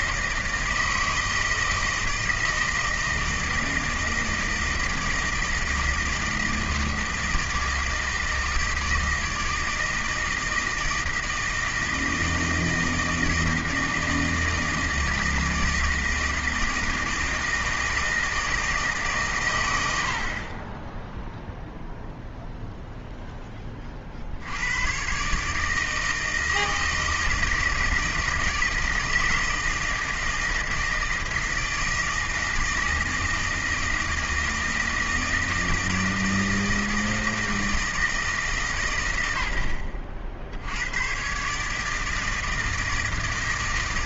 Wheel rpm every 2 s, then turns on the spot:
160, 160, 160, 160, 160, 160, 160, 160, 160, 160, 20, 0, 100, 160, 160, 160, 160, 160, 160, 140, 80, 160.
none